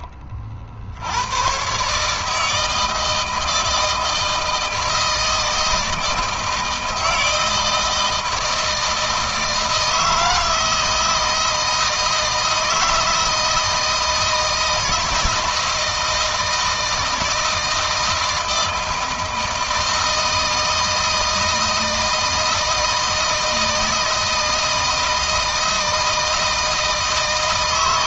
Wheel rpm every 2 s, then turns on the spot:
50, 160, 160, 160, 160, 160, 160, 160, 160, 160, 160, 160, 160, 160.
none